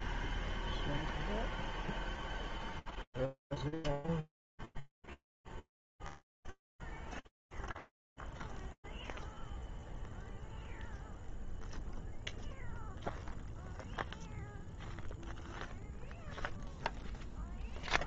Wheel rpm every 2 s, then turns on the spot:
0, 0, 0, 0, 0, 0, 0, 0, 0.
none